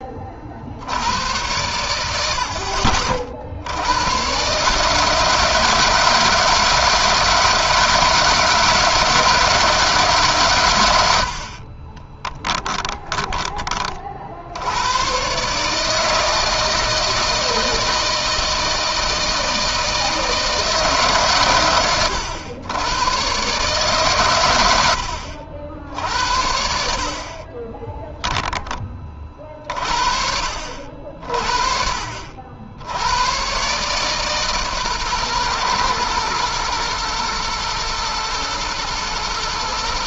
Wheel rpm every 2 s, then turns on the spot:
70, 60, 140, 160, 160, 110, 20, 90, 160, 160, 150, 100, 110, 60, 10, 60, 80, 130, 120, 110.
12-14